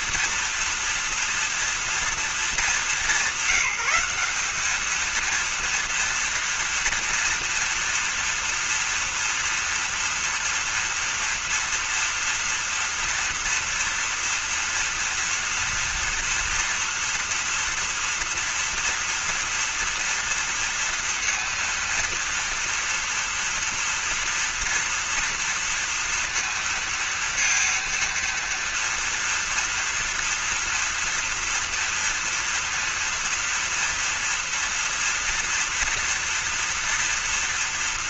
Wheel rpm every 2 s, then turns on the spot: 230, 210, 200, 230, 230, 230, 230, 230, 230, 230, 240, 230, 230, 230, 230, 240, 230, 230, 230.
none